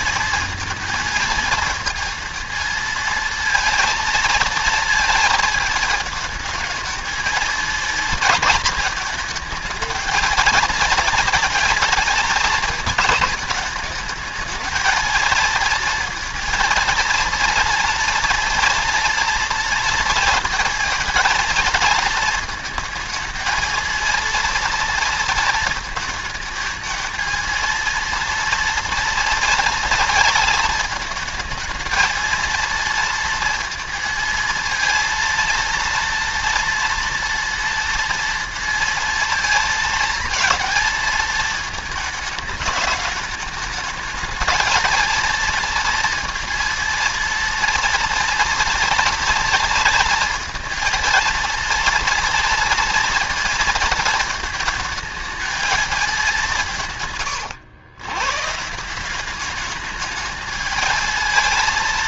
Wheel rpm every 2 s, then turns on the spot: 230, 230, 230, 220, 220, 230, 220, 220, 230, 240, 230, 220, 230, 220, 230, 220, 230, 230, 230, 230, 220, 210, 230, 230, 230, 230, 230, 220, 180, 160, 220.
none